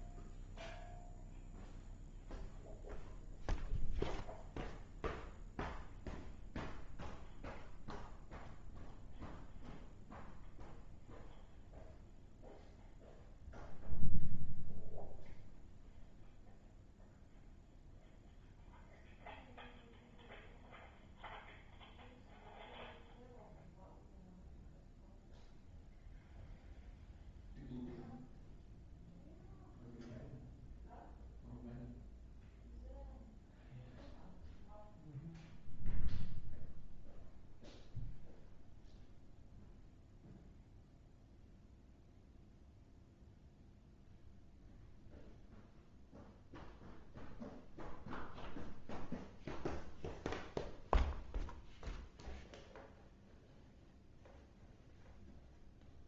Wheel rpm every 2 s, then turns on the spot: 0, 0, 0, 0, 0, 0, 0, 0, 0, 0, 0, 0, 0, 0, 0, 0, 0, 0, 0, 0, 0, 0, 0, 0, 0, 0, 0, 0.
none